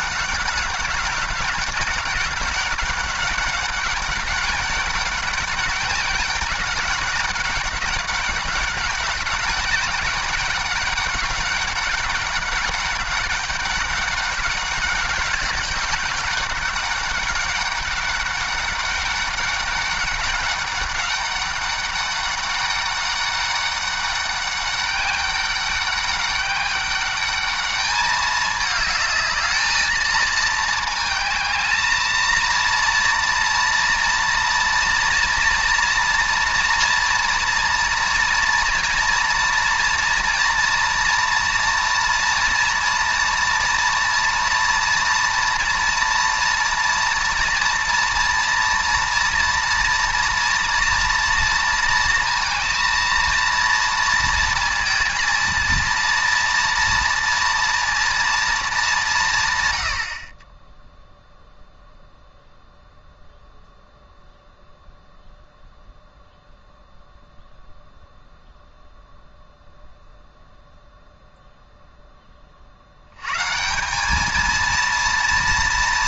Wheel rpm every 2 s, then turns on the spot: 190, 200, 200, 190, 200, 200, 200, 200, 200, 200, 190, 200, 200, 200, 210, 220, 230, 230, 230, 230, 230, 230, 240, 230, 230, 230, 230, 230, 230, 210, 0, 0, 0, 0, 0, 0, 70, 230.
none